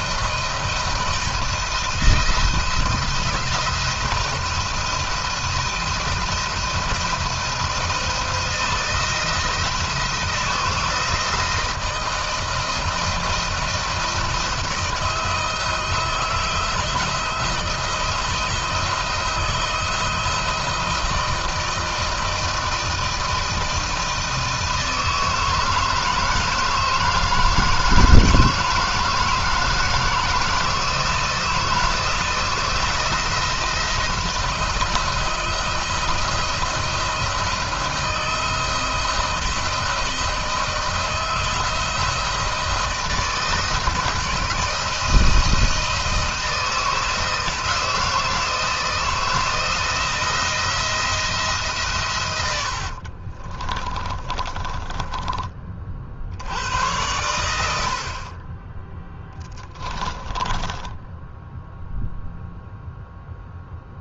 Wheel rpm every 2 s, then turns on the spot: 160, 170, 170, 170, 160, 160, 170, 170, 170, 170, 160, 160, 160, 160, 160, 160, 170, 170, 170, 160, 160, 170, 170, 160, 160, 170, 60, 20, 100, 20, 10, 0.
52-56 60-62